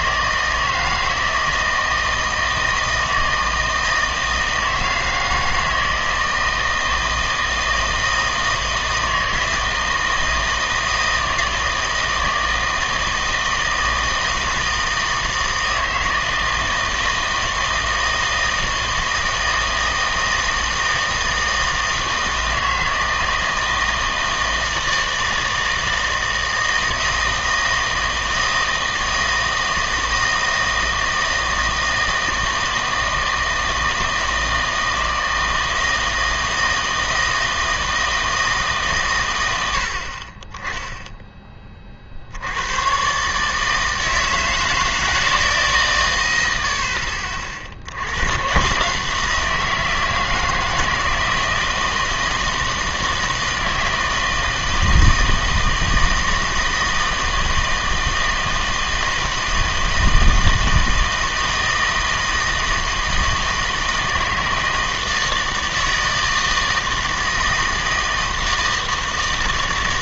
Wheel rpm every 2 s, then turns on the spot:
160, 160, 160, 160, 160, 160, 160, 160, 160, 160, 160, 160, 160, 160, 160, 160, 160, 160, 160, 150, 10, 100, 160, 70, 130, 160, 160, 160, 160, 160, 160, 160, 160, 160, 160.
none